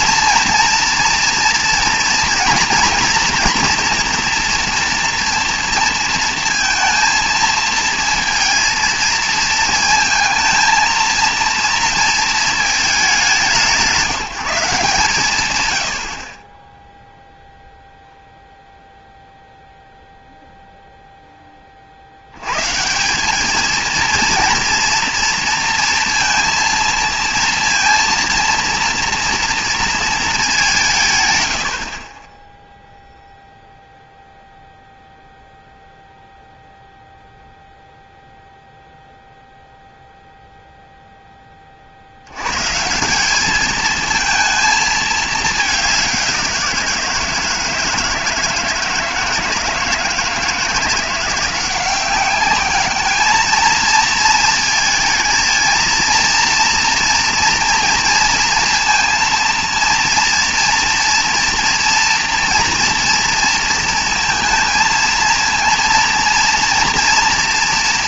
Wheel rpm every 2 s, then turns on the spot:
230, 230, 230, 230, 230, 220, 220, 170, 20, 0, 0, 130, 230, 230, 230, 190, 0, 0, 0, 0, 0, 130, 220, 180, 160, 170, 200, 230, 230, 230, 230, 230, 230, 230.
none